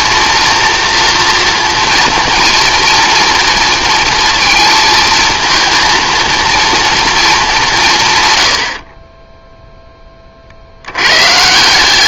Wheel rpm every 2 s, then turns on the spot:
230, 230, 220, 230, 40, 80.
none